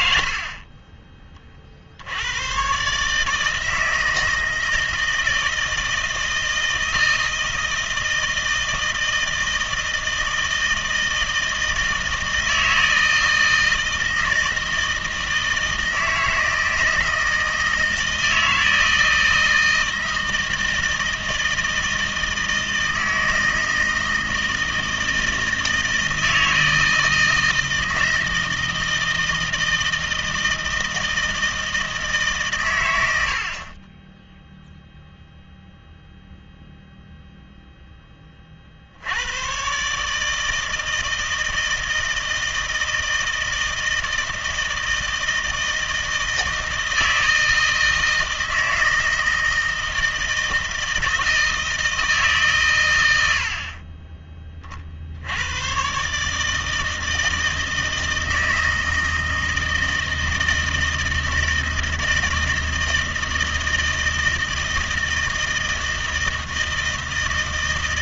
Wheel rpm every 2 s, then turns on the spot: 30, 140, 160, 160, 160, 160, 160, 160, 160, 160, 160, 160, 160, 160, 160, 160, 130, 0, 0, 60, 160, 160, 160, 160, 160, 160, 130, 50, 160, 160, 160, 160, 160, 160.
none